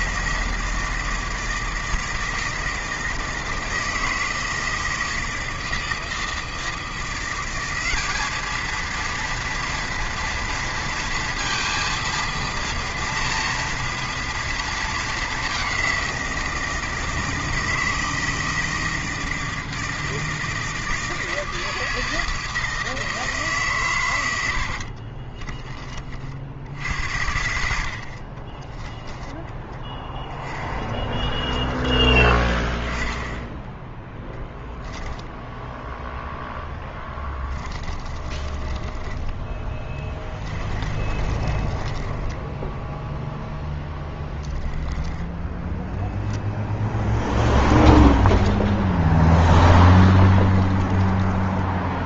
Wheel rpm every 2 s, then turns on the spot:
170, 160, 160, 160, 220, 230, 230, 230, 170, 160, 160, 160, 80, 60, 30, 10, 20, 10, 10, 20, 20, 10, 10, 0, 10, 20.
24-26 28-32 34-44 50-52